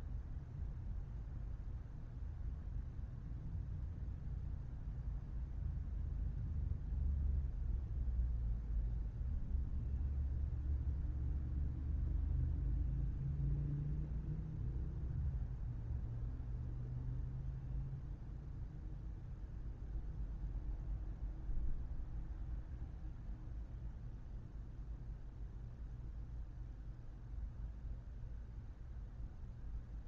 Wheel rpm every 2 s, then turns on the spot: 0, 0, 0, 0, 0, 0, 0, 0, 0, 0, 0, 0, 0, 0, 0.
none